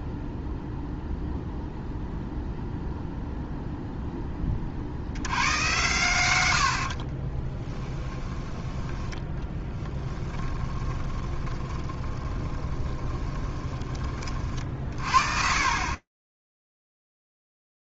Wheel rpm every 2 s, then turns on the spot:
0, 0, 40, 90, 10, 10, 20, 40, 0.
6-8 10-14